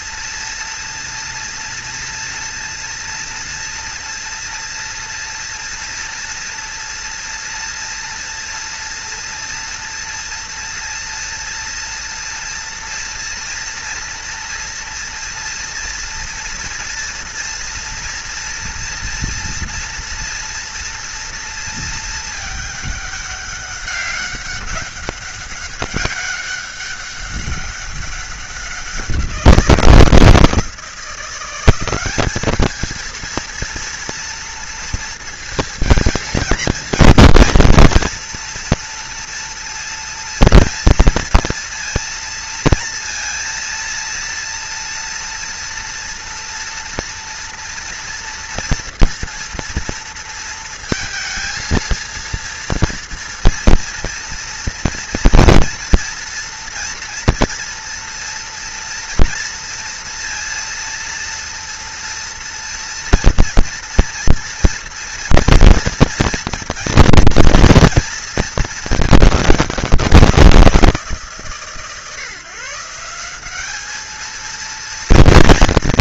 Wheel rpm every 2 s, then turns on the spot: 230, 230, 230, 230, 230, 230, 230, 240, 230, 230, 230, 220, 200, 200, 190, 160, 210, 230, 230, 230, 230, 230, 230, 230, 230, 230, 230, 230, 230, 230, 230, 230, 230, 230, 220, 180, 150, 220.
none